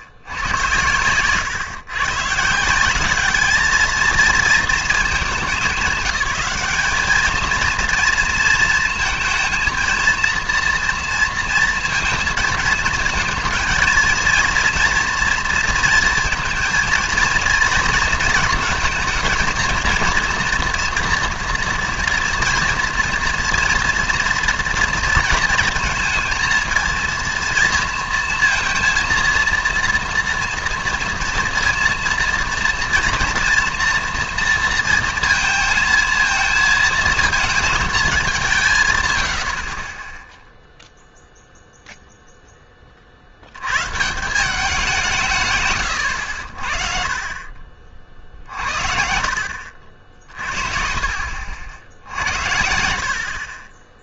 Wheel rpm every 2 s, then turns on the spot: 100, 160, 220, 200, 230, 230, 230, 230, 230, 220, 230, 230, 230, 230, 230, 240, 230, 230, 230, 170, 0, 20, 180, 60, 50, 40, 80.
none